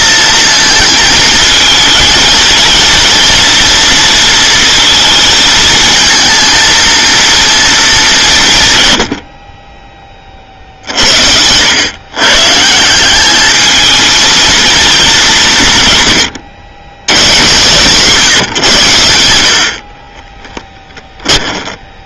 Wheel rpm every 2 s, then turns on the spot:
220, 220, 230, 230, 150, 50, 160, 220, 110, 120, 10.
20-22